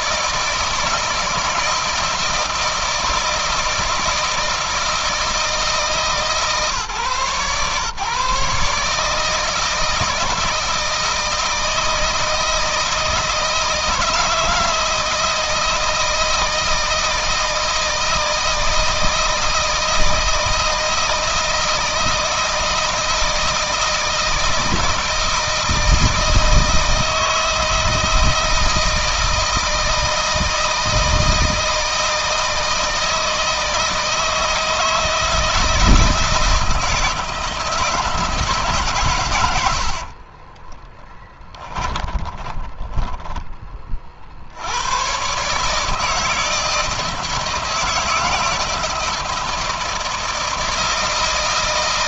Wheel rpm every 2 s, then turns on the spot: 160, 160, 160, 140, 150, 160, 160, 160, 160, 160, 160, 160, 160, 160, 160, 160, 160, 160, 160, 140, 20, 20, 90, 160, 170, 160.
40-44